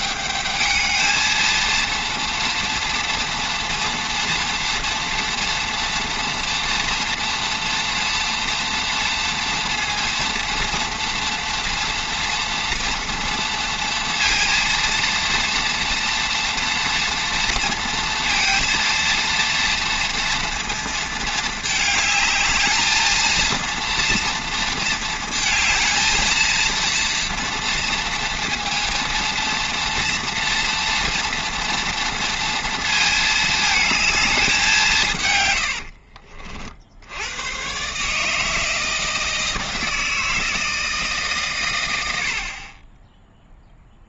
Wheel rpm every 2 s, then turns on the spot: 210, 230, 240, 230, 230, 230, 230, 230, 240, 230, 230, 210, 230, 230, 230, 230, 230, 210, 50, 150, 160, 60.
none